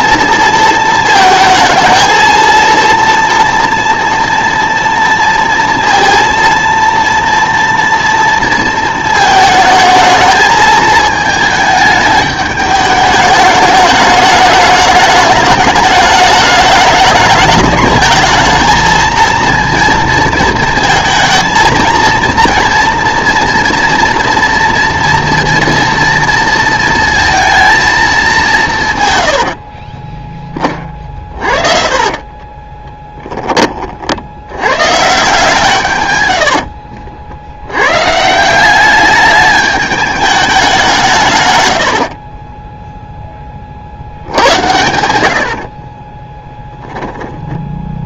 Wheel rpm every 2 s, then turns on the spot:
230, 230, 230, 230, 230, 220, 210, 210, 210, 220, 220, 230, 240, 230, 170, 20, 20, 130, 80, 180, 190, 0, 90, 10.
32-34 36-38